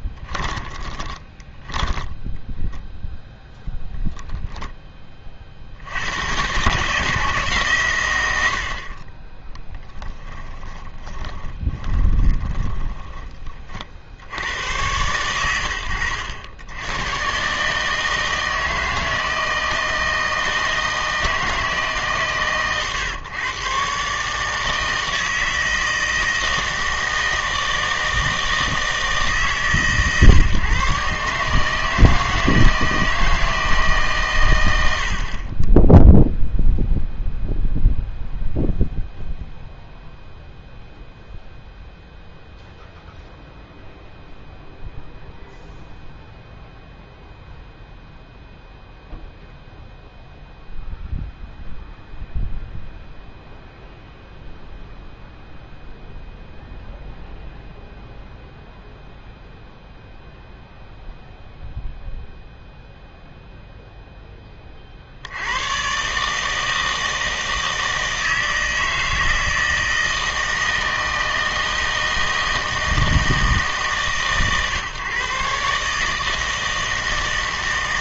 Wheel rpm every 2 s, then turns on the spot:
20, 0, 10, 130, 70, 30, 10, 110, 100, 160, 160, 120, 160, 160, 160, 130, 160, 90, 0, 0, 0, 0, 0, 0, 0, 0, 0, 0, 0, 0, 0, 0, 30, 160, 160, 160, 160, 140, 160.
0-2 10-14